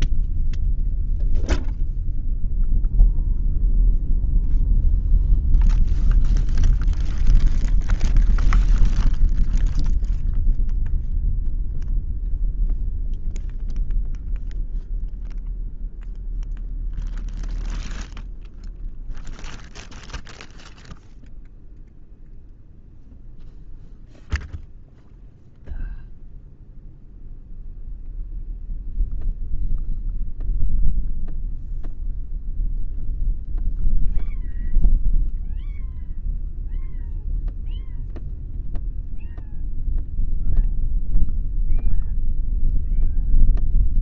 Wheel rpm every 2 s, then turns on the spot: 0, 0, 0, 0, 0, 0, 0, 0, 0, 0, 0, 0, 0, 0, 0, 0, 0, 0, 0, 0, 0, 0.
none